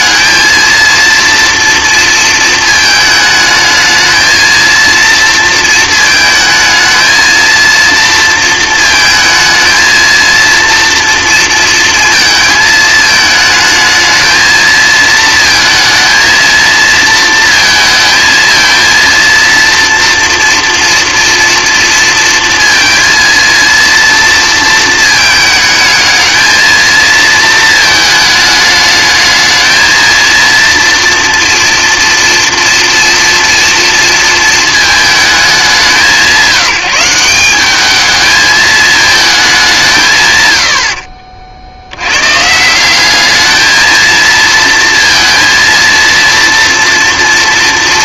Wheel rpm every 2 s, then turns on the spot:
230, 220, 230, 220, 230, 230, 220, 230, 230, 230, 230, 230, 230, 220, 210, 230, 240, 220, 180, 220, 60, 180, 230, 230.
none